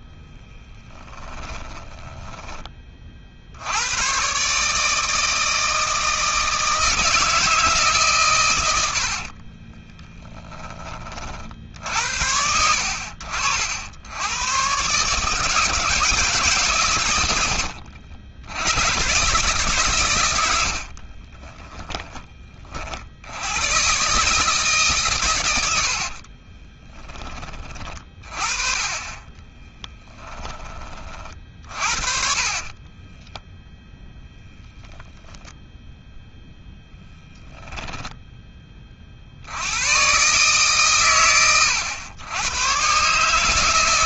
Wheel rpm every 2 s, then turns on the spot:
10, 40, 160, 160, 80, 40, 80, 130, 110, 130, 60, 70, 130, 20, 30, 40, 10, 0, 10, 50, 120, 130.
0-2 8-10 20-22 28-30 32-34 36-38